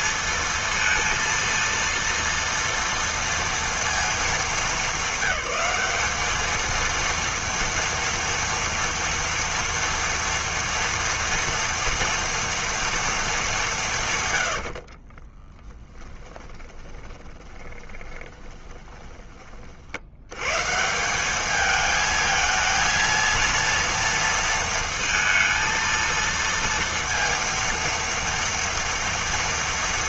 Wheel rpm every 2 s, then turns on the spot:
230, 230, 210, 220, 230, 240, 230, 90, 20, 20, 140, 230, 230, 230, 240.
16-20